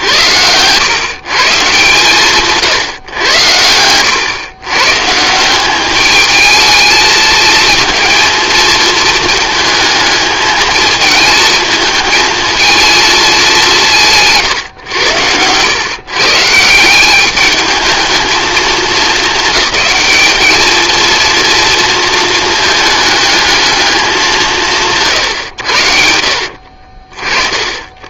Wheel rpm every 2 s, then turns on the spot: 140, 130, 150, 220, 220, 220, 220, 110, 170, 220, 230, 220, 160, 60.
2-4